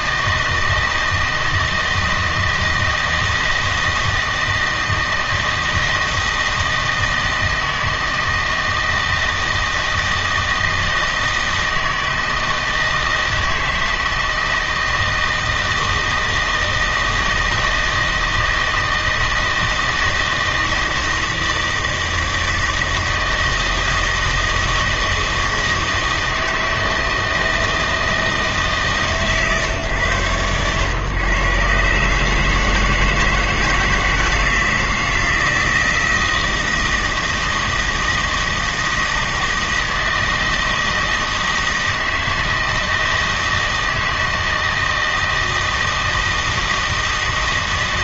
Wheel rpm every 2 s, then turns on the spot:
160, 160, 160, 160, 160, 170, 160, 160, 160, 160, 160, 160, 160, 160, 150, 120, 160, 160, 160, 160, 160, 160, 160, 160.
none